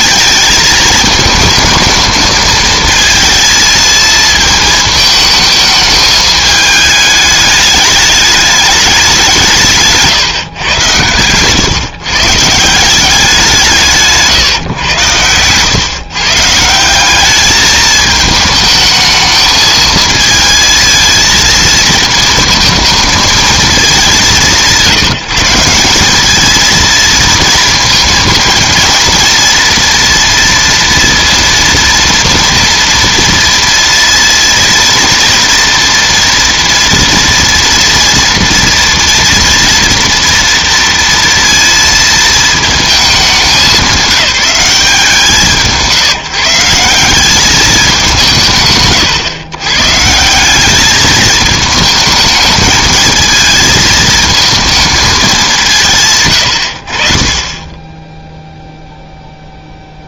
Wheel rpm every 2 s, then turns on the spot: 220, 220, 220, 210, 200, 120, 170, 120, 180, 220, 230, 220, 170, 230, 220, 240, 230, 230, 230, 230, 230, 220, 190, 160, 140, 200, 220, 220, 80, 0.
none